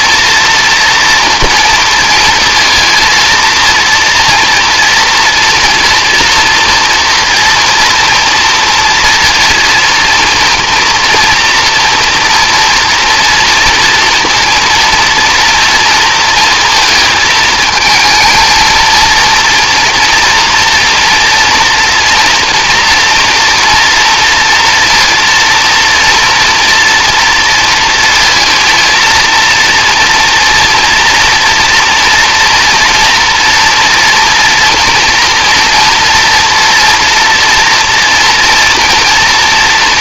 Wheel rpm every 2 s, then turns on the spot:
240, 230, 230, 240, 230, 230, 240, 230, 230, 230, 230, 230, 230, 230, 230, 240, 230, 230, 230, 230.
none